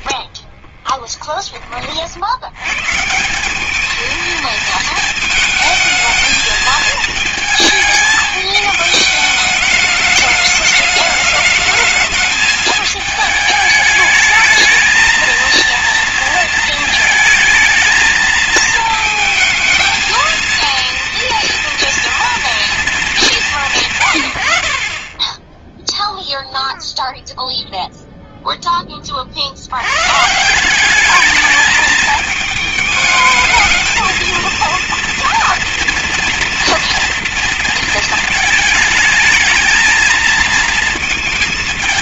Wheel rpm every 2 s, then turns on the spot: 50, 100, 220, 220, 210, 210, 220, 220, 230, 220, 230, 230, 80, 0, 10, 170, 210, 230, 240, 220, 230.
0-2